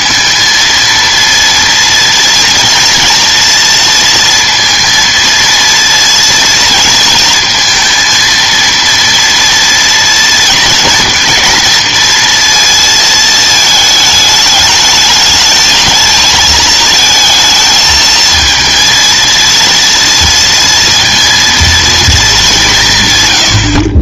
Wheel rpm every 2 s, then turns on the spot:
230, 230, 230, 230, 230, 230, 230, 210, 220, 230, 230, 190.
none